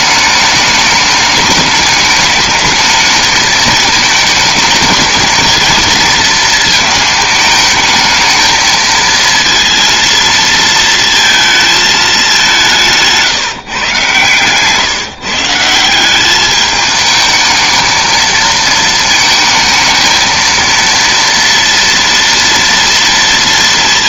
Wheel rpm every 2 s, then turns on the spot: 210, 220, 220, 220, 220, 230, 180, 130, 210, 220, 230, 230.
none